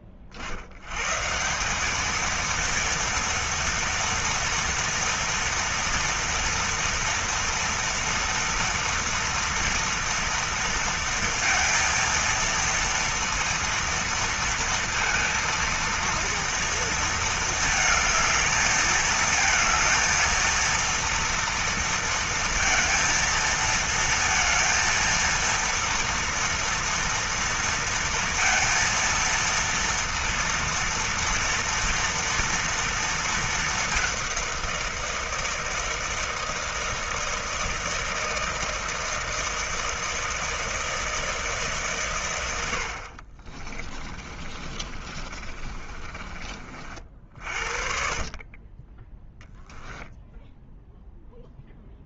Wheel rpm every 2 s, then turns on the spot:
40, 220, 230, 230, 230, 230, 230, 230, 230, 220, 230, 230, 230, 230, 230, 230, 230, 190, 160, 160, 160, 110, 30, 40, 30, 0.
44-46